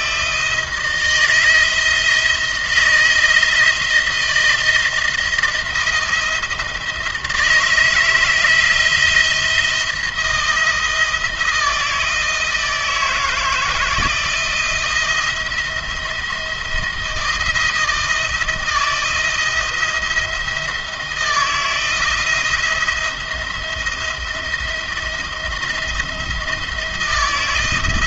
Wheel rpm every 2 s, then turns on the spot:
160, 170, 160, 160, 160, 160, 160, 160, 170, 170, 160, 170, 170, 170.
none